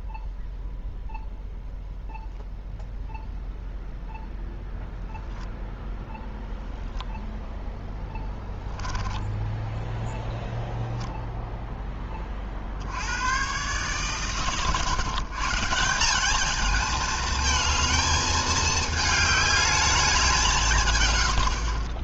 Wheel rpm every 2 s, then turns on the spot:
0, 0, 0, 0, 10, 0, 60, 130, 210, 220, 170.
8-10